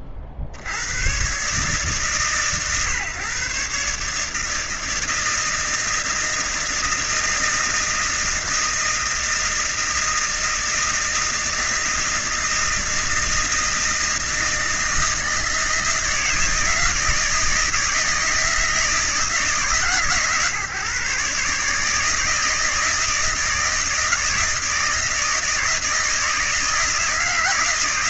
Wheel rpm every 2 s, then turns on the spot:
70, 130, 160, 160, 160, 160, 160, 160, 160, 160, 130, 160, 160, 160.
none